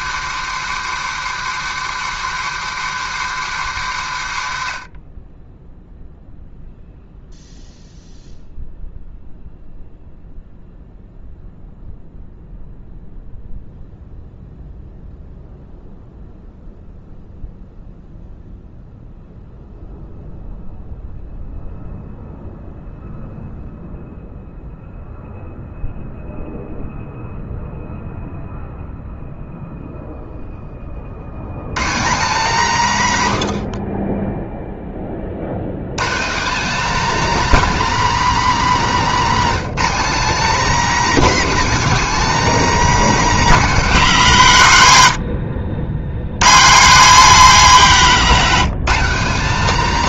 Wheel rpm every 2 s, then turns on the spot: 150, 150, 50, 0, 0, 0, 0, 0, 0, 0, 0, 0, 0, 0, 0, 40, 160, 20, 250, 250, 260, 270, 130, 190, 230.
none